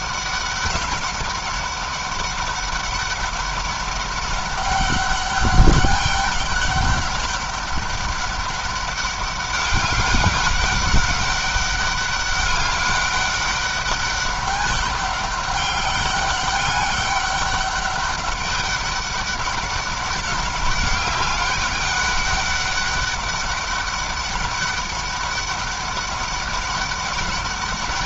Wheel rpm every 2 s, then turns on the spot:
200, 200, 200, 200, 200, 200, 190, 200, 200, 200, 190, 200, 200, 200.
none